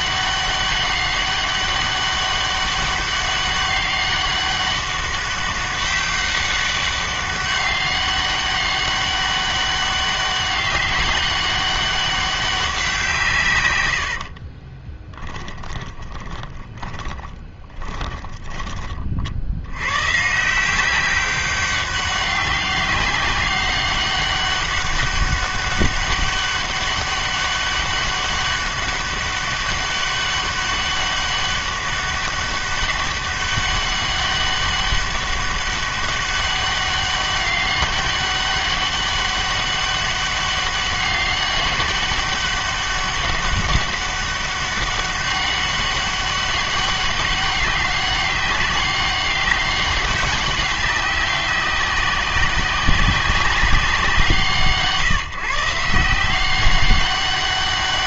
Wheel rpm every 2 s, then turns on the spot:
200, 200, 200, 200, 200, 200, 180, 30, 20, 30, 170, 190, 200, 200, 200, 200, 200, 200, 200, 200, 200, 200, 200, 200, 190, 200, 190, 150, 190.
14-18